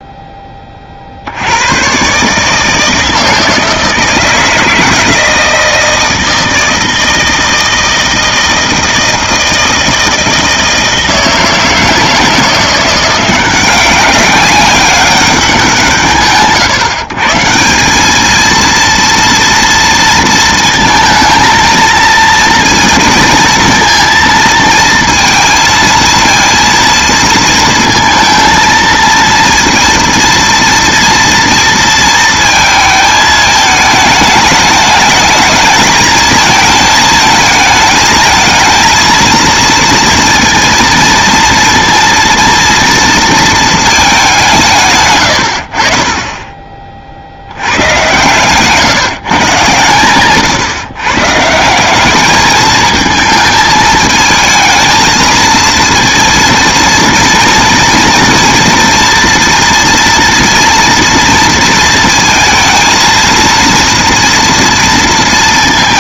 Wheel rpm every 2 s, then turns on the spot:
20, 160, 160, 160, 160, 160, 170, 190, 130, 230, 230, 230, 230, 230, 230, 230, 220, 210, 220, 220, 230, 230, 170, 20, 140, 130, 220, 220, 230, 230, 230, 230, 230.
none